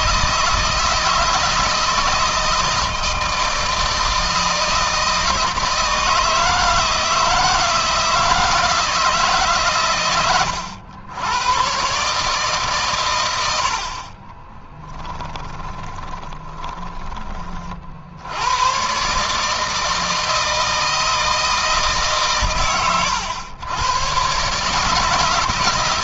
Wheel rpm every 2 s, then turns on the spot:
160, 160, 160, 160, 160, 100, 120, 20, 20, 130, 160, 120, 160.
14-16